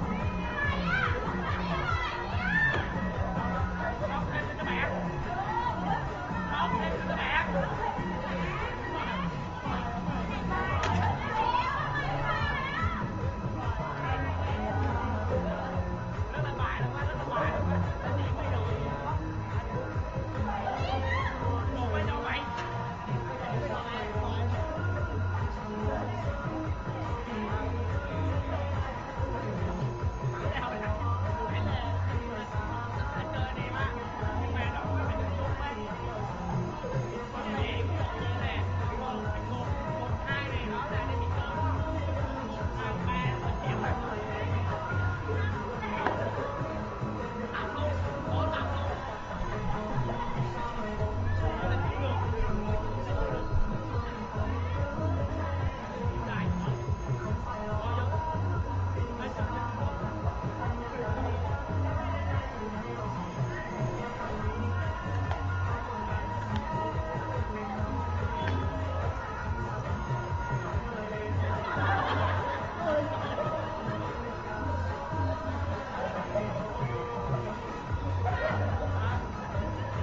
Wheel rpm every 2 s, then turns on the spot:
0, 0, 0, 0, 0, 0, 0, 0, 0, 0, 0, 0, 0, 0, 0, 0, 0, 0, 0, 0, 0, 0, 0, 0, 0, 0, 0, 0, 0, 0, 0, 0, 0, 0, 0, 0, 0, 0, 0, 0.
none